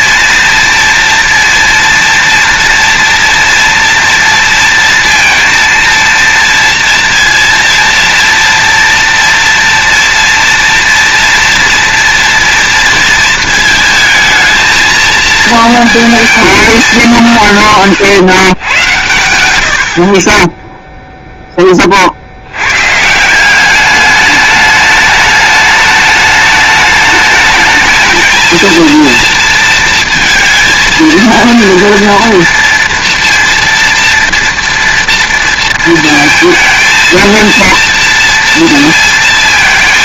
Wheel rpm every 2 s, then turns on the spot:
230, 230, 230, 230, 230, 230, 230, 220, 210, 100, 10, 90, 210, 210, 230, 220, 230, 230, 230, 230.
none